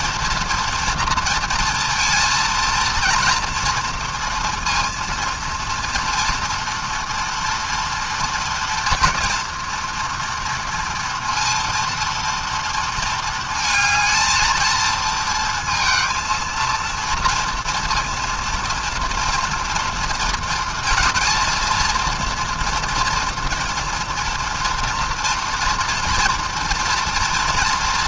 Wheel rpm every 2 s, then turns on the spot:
230, 230, 230, 230, 230, 230, 230, 220, 230, 230, 230, 230, 230, 240.
none